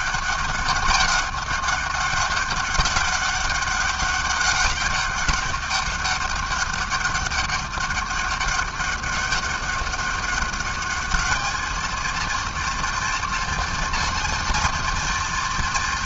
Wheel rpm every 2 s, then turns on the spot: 200, 200, 200, 200, 200, 210, 230, 230.
none